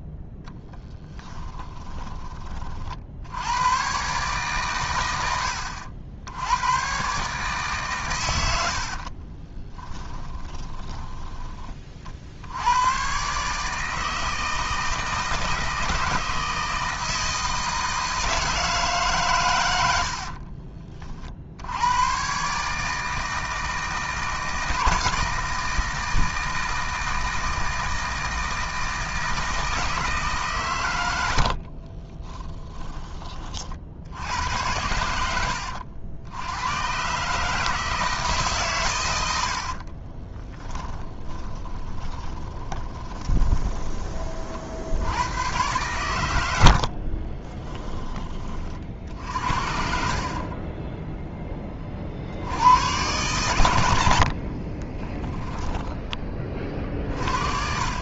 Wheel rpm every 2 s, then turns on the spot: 10, 40, 120, 110, 60, 10, 90, 160, 160, 150, 40, 150, 160, 160, 160, 120, 10, 80, 110, 120, 10, 20, 70, 60, 40, 20, 100, 30, 40.
0-2 8-12 40-44 46-48 50-52 54-56